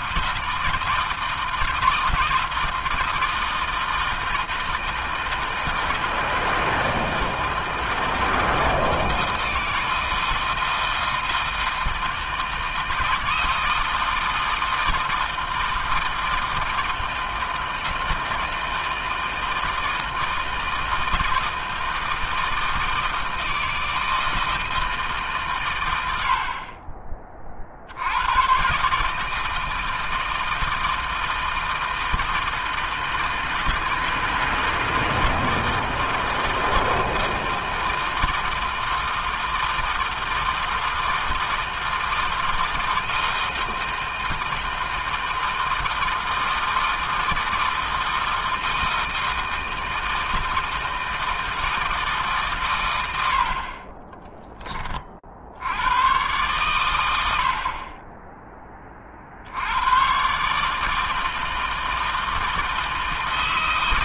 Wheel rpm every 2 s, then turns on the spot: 160, 160, 160, 160, 160, 160, 160, 160, 160, 160, 160, 160, 160, 70, 110, 160, 160, 160, 160, 160, 160, 160, 160, 160, 160, 160, 140, 20, 120, 10, 130, 160.
none